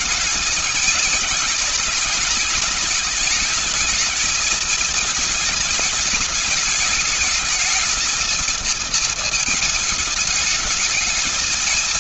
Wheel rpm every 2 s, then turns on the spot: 220, 210, 220, 210, 220, 210.
none